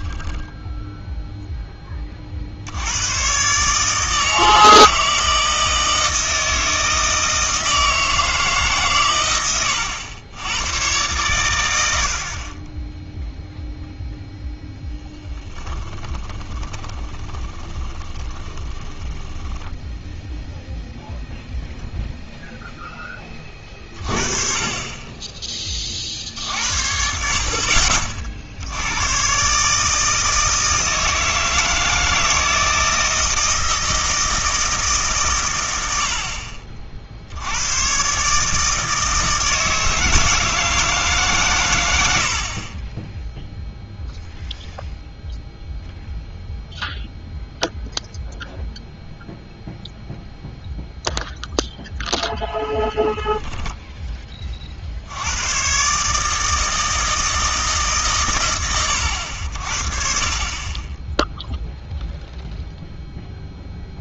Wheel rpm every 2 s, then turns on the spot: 10, 70, 160, 160, 140, 110, 10, 10, 20, 20, 0, 0, 30, 60, 70, 160, 160, 160, 40, 150, 160, 40, 0, 0, 0, 0, 0, 40, 160, 110, 30, 0.
16-20